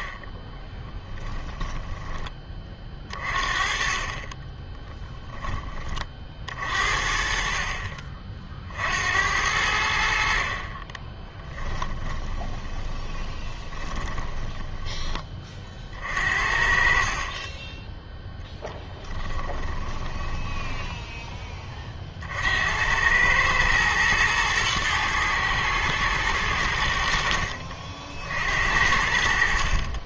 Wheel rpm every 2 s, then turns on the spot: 10, 30, 10, 50, 60, 40, 20, 10, 50, 10, 10, 80, 110, 90, 60.
0-2 4-6 12-16 18-22